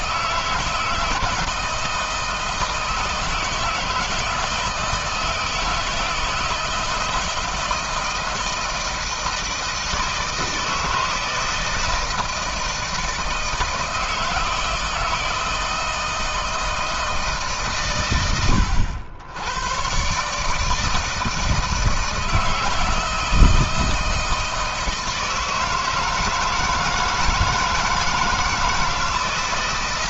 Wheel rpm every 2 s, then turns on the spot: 160, 160, 160, 160, 160, 160, 160, 160, 160, 100, 160, 160, 160, 160, 160.
none